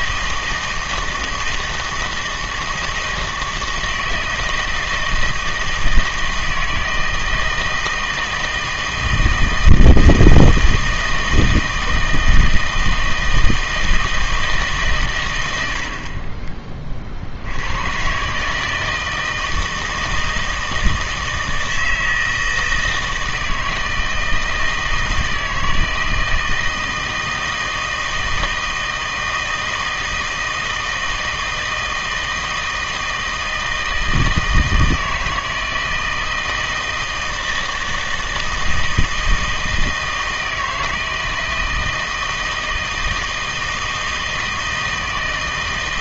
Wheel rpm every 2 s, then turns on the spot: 160, 160, 160, 160, 160, 160, 160, 150, 30, 150, 160, 160, 160, 160, 160, 160, 160, 160, 160, 160, 160, 160, 160.
none